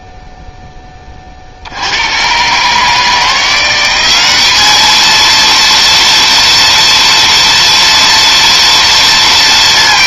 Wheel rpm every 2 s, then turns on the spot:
0, 110, 190, 230, 230.
none